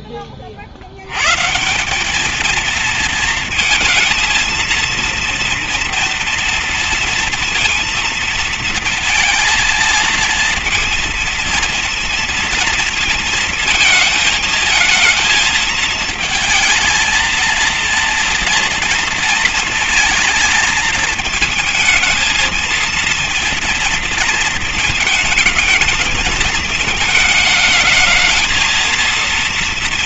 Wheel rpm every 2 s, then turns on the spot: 40, 220, 230, 230, 230, 230, 230, 220, 230, 230, 220, 220, 230, 220, 230.
none